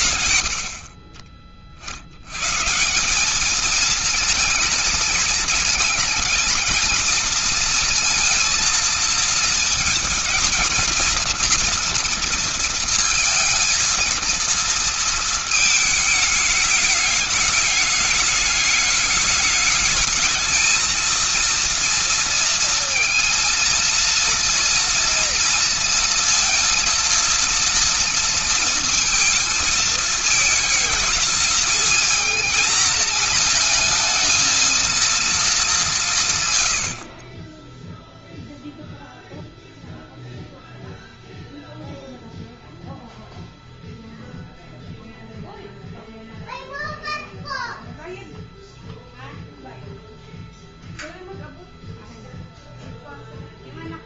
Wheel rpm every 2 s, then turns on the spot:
70, 180, 220, 230, 230, 230, 230, 230, 210, 210, 230, 230, 230, 230, 230, 220, 220, 230, 70, 0, 0, 0, 0, 0, 0, 0, 0.
none